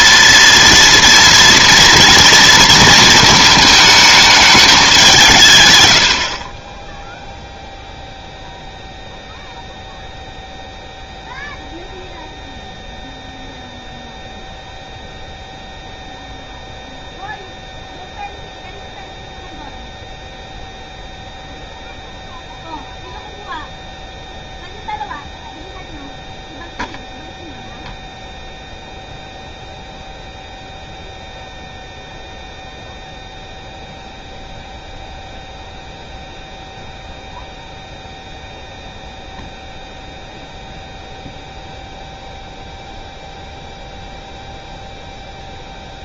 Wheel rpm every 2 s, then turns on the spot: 230, 230, 210, 30, 0, 0, 0, 0, 0, 0, 0, 0, 0, 0, 0, 0, 0, 0, 0, 0, 0, 0, 0.
none